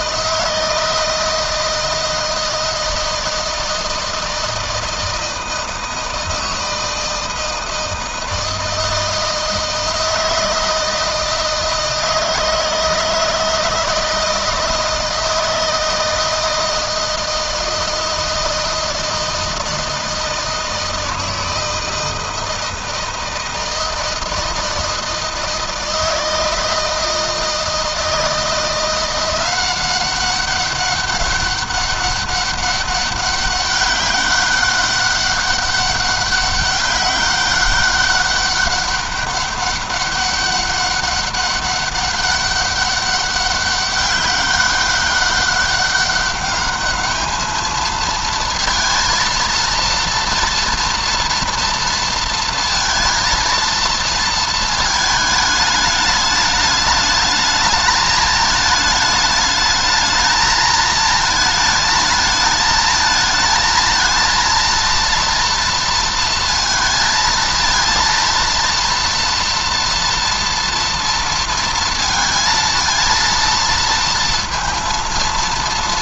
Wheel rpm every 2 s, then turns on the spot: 160, 160, 160, 160, 160, 160, 160, 160, 160, 160, 160, 160, 160, 160, 170, 200, 200, 200, 200, 200, 200, 200, 200, 210, 230, 230, 230, 220, 210, 210, 220, 220, 230, 230, 230, 230, 230, 230.
none